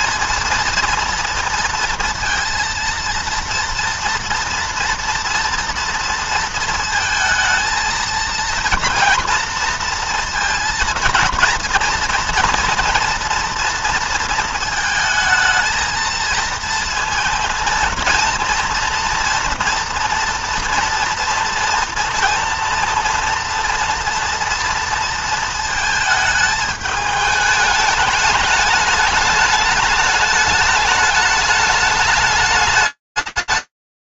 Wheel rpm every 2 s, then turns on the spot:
230, 230, 230, 230, 230, 230, 230, 230, 230, 240, 230, 230, 230, 220, 210, 210, 140.
none